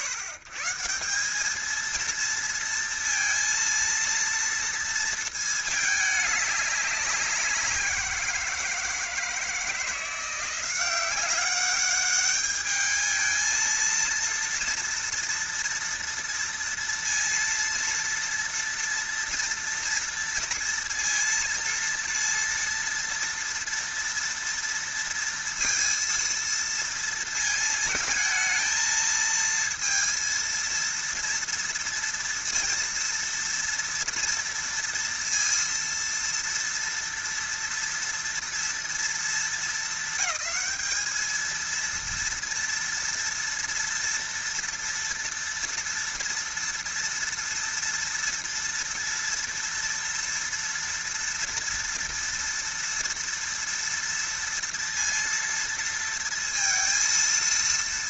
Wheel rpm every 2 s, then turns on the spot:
140, 230, 230, 200, 170, 180, 210, 230, 230, 230, 230, 230, 230, 230, 220, 230, 230, 230, 230, 230, 200, 230, 230, 230, 230, 230, 230, 230, 230.
none